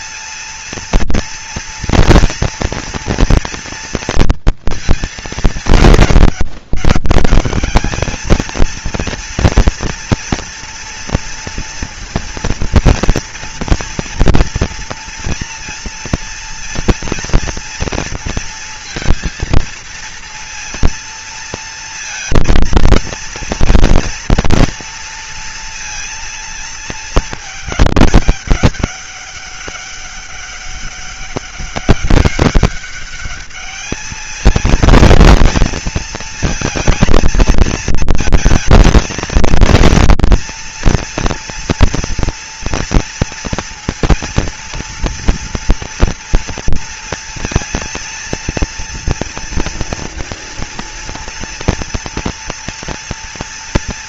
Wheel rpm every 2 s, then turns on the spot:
230, 230, 230, 210, 220, 240, 230, 230, 240, 230, 230, 230, 230, 230, 200, 200, 200, 220, 230, 220, 230, 230, 240, 230, 230, 230, 230.
none